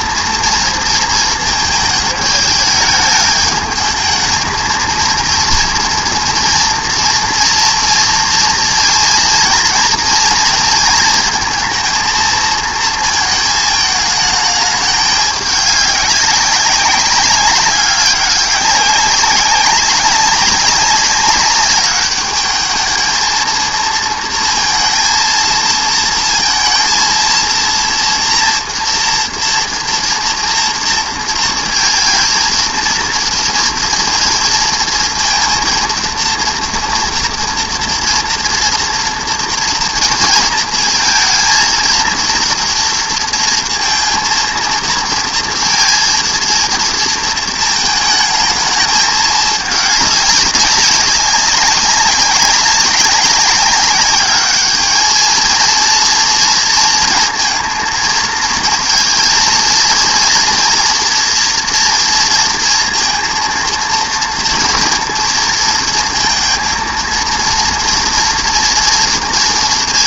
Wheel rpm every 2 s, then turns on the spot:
230, 210, 220, 230, 230, 230, 230, 210, 200, 200, 200, 210, 230, 230, 230, 230, 230, 230, 240, 230, 230, 230, 230, 230, 220, 200, 200, 210, 230, 220, 230, 230, 230, 230, 230.
none